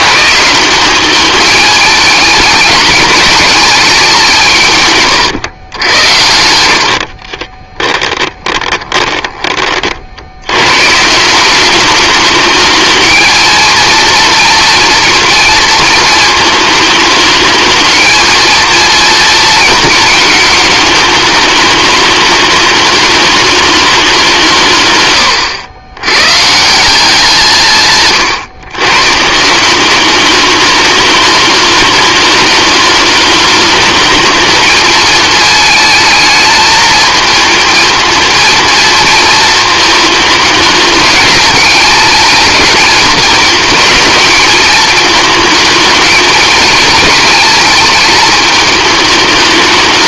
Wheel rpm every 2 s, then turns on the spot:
190, 210, 140, 60, 20, 140, 210, 230, 220, 230, 220, 210, 120, 170, 130, 210, 210, 220, 220, 230, 210, 220, 220, 230, 220.
6-10